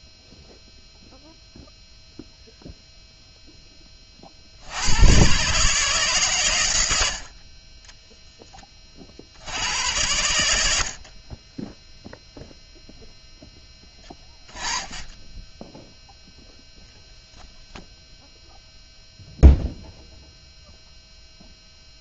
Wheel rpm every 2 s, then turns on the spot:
0, 0, 100, 90, 40, 60, 0, 10, 0, 0, 0.
none